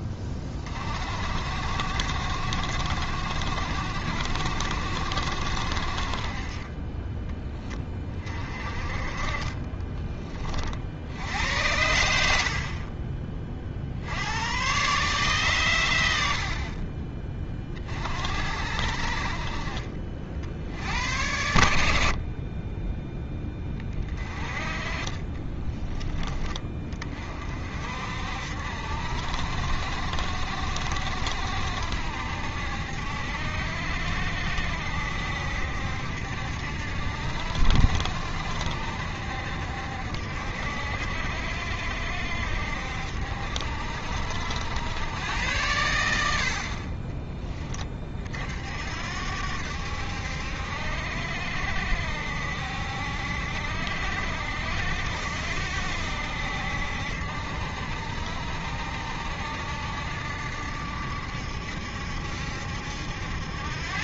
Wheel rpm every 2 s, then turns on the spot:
40, 70, 70, 20, 30, 50, 50, 120, 40, 60, 80, 20, 30, 20, 60, 70, 70, 70, 70, 70, 60, 60, 90, 40, 60, 70, 70, 70, 70, 70, 70, 70.
6-8